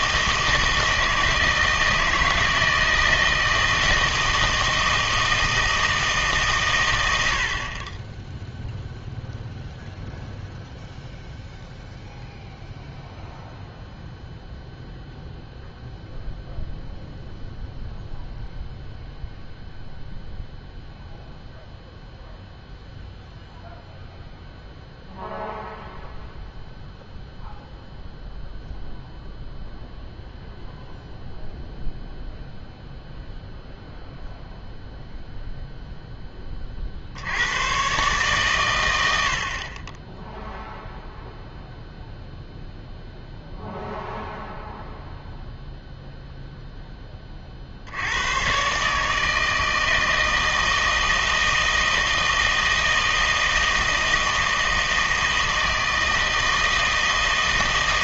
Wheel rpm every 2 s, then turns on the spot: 160, 160, 160, 130, 0, 0, 0, 0, 0, 0, 0, 0, 0, 0, 0, 0, 0, 0, 30, 110, 0, 0, 0, 0, 130, 160, 160, 160, 160.
none